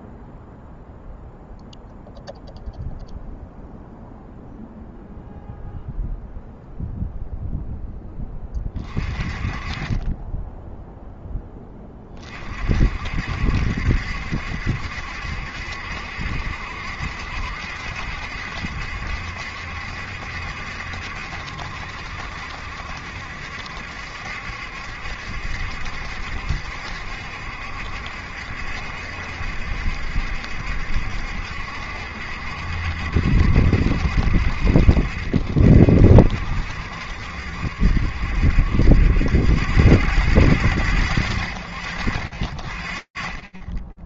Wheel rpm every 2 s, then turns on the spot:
0, 0, 0, 0, 20, 10, 40, 70, 70, 70, 70, 70, 70, 70, 70, 70, 70, 60, 60, 70, 100, 40.
none